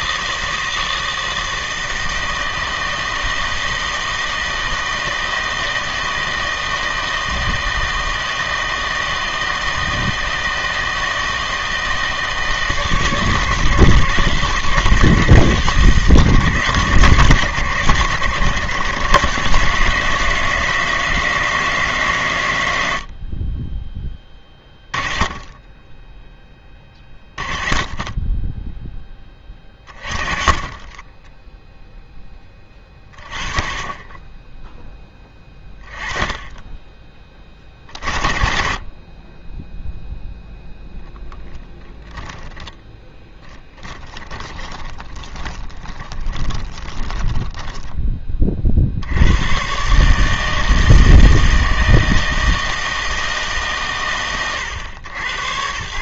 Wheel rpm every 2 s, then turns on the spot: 160, 160, 160, 160, 160, 160, 160, 160, 140, 130, 160, 90, 20, 20, 10, 30, 20, 10, 20, 30, 0, 10, 20, 20, 50, 160, 160, 110.
44-48